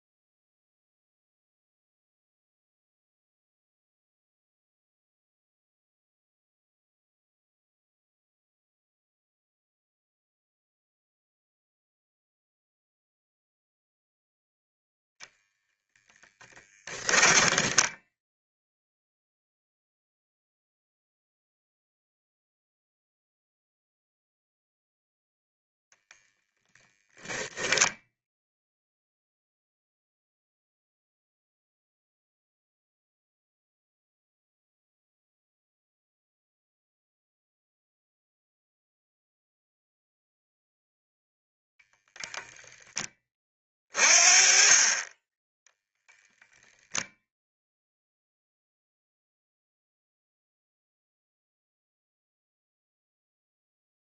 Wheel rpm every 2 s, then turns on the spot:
0, 0, 0, 0, 0, 0, 0, 10, 10, 0, 0, 0, 0, 0, 0, 0, 0, 0, 0, 0, 0, 10, 20, 0, 0, 0, 0.
16-18